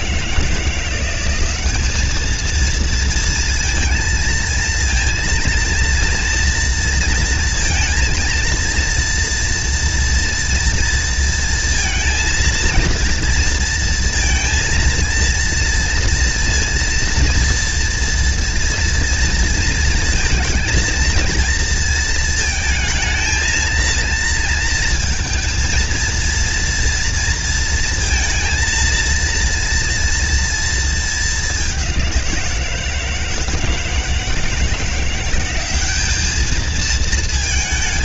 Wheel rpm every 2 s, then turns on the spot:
180, 230, 230, 230, 230, 230, 230, 230, 230, 230, 230, 220, 230, 230, 230, 220, 170, 170, 220.
none